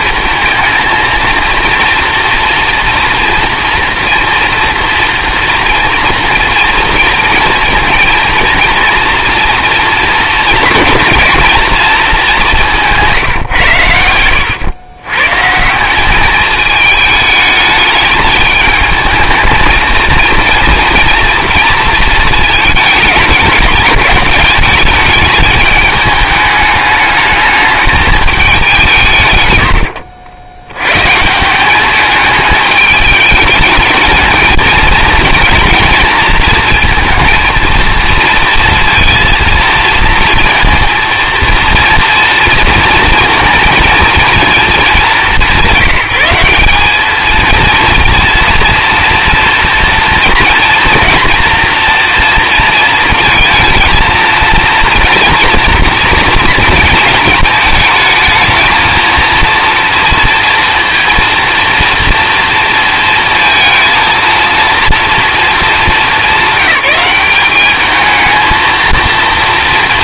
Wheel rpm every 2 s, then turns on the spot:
230, 230, 230, 230, 230, 230, 200, 110, 210, 210, 230, 220, 210, 210, 190, 90, 210, 230, 220, 230, 230, 230, 220, 190, 240, 240, 230, 230, 230, 230, 240, 230, 230, 200, 220.
none